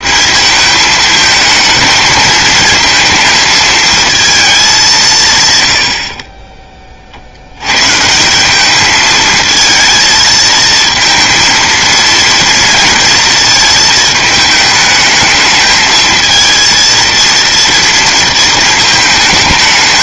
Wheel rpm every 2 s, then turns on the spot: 210, 220, 200, 30, 200, 230, 230, 220, 230, 220.
none